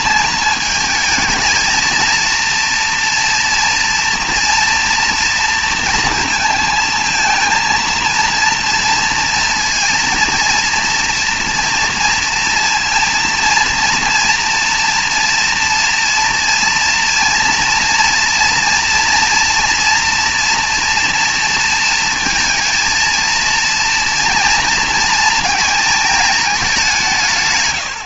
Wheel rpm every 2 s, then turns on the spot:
220, 230, 240, 230, 230, 230, 230, 230, 240, 230, 230, 230, 230, 220.
none